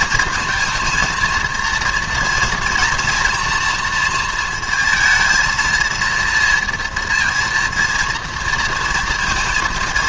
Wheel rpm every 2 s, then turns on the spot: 220, 230, 230, 230, 230.
none